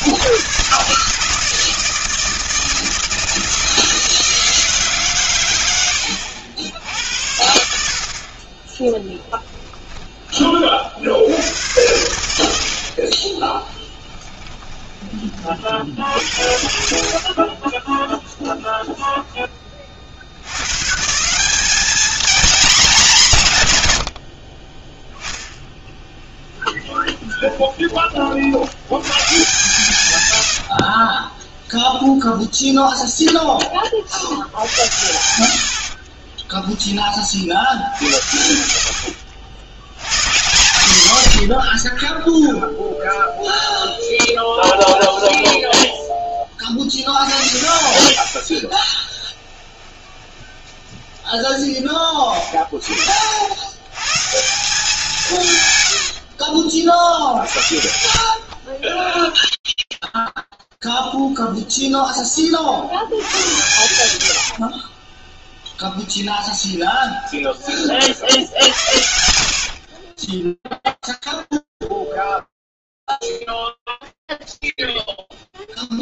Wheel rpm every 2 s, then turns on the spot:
120, 160, 160, 90, 30, 40, 80, 20, 70, 0, 100, 220, 30, 10, 60, 80, 0, 70, 10, 70, 140, 10, 10, 40, 40, 20, 20, 160, 60, 40, 0, 10, 90, 20, 50, 20, 0, 0.
12-16 30-32 36-38 42-46 48-52 56-60 64-68 70-72